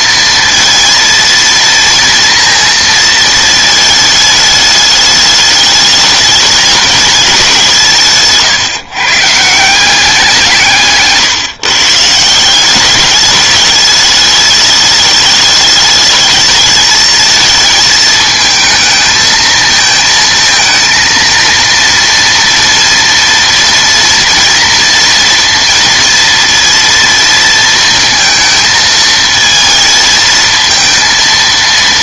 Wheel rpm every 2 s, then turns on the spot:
230, 230, 210, 210, 150, 150, 190, 210, 220, 220, 230, 230, 230, 230, 220, 230.
none